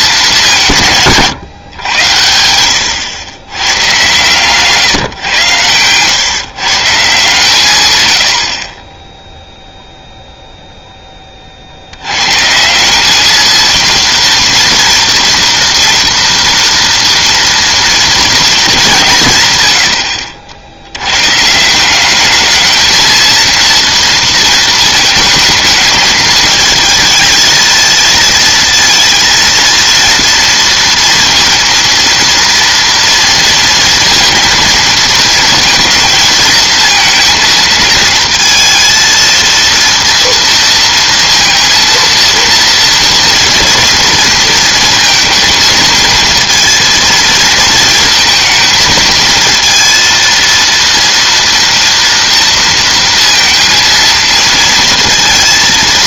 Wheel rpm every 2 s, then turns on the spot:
170, 80, 140, 150, 30, 0, 180, 230, 230, 200, 80, 220, 220, 220, 230, 230, 230, 230, 220, 230, 230, 230, 230, 230, 220, 230, 230, 230.
none